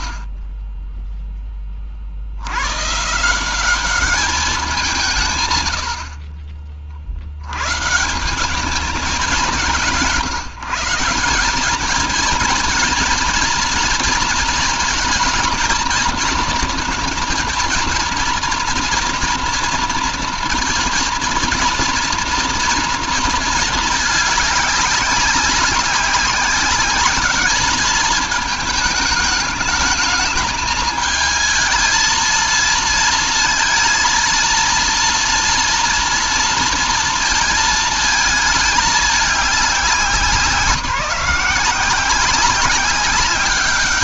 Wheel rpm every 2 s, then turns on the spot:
0, 110, 190, 40, 190, 170, 230, 220, 220, 230, 240, 230, 200, 200, 210, 220, 220, 230, 230, 220, 180, 190.
none